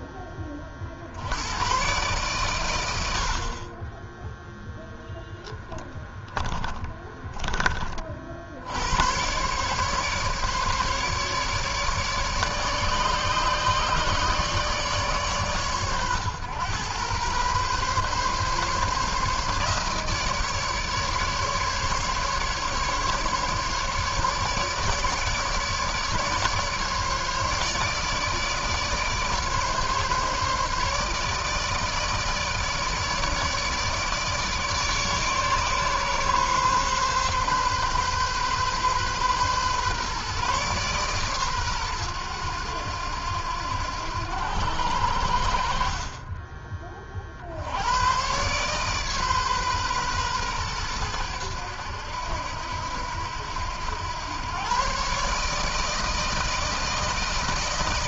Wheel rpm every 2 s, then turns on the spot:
40, 110, 0, 10, 80, 150, 150, 150, 120, 140, 150, 150, 150, 150, 150, 150, 160, 150, 140, 130, 140, 100, 90, 30, 130, 120, 80, 120, 160.
6-8